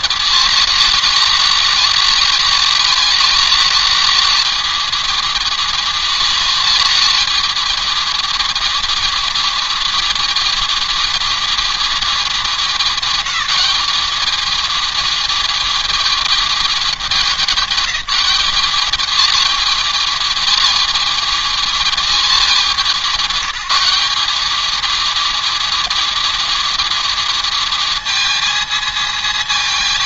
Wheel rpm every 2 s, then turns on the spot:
220, 220, 230, 230, 220, 220, 210, 210, 220, 210, 220, 210, 210, 220, 220.
none